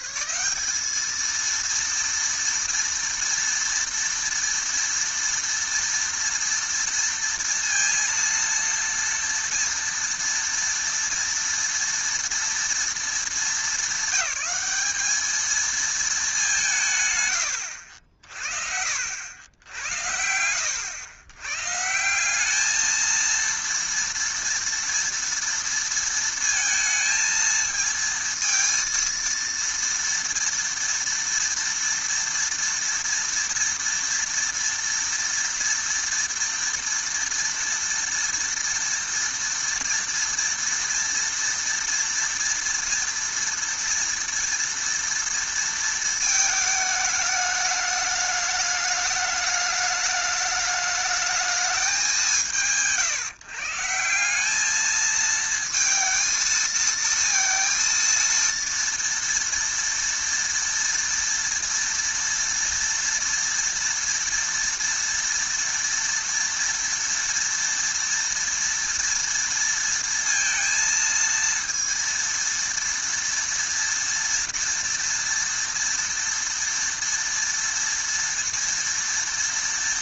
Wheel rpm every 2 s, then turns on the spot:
220, 230, 230, 230, 230, 230, 220, 220, 110, 70, 100, 230, 230, 230, 230, 240, 230, 230, 240, 230, 230, 230, 230, 210, 210, 210, 120, 220, 220, 230, 230, 230, 230, 230, 230, 230, 230, 230, 230, 230.
none